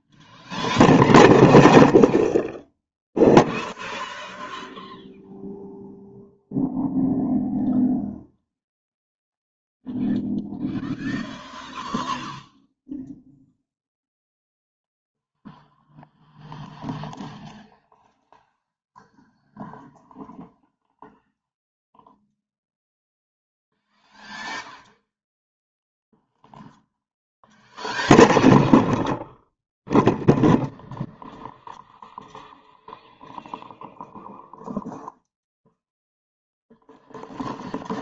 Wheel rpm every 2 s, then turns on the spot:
0, 0, 0, 0, 0, 0, 0, 0, 0, 0, 0, 0, 0, 0, 0, 0, 0, 0, 0.
none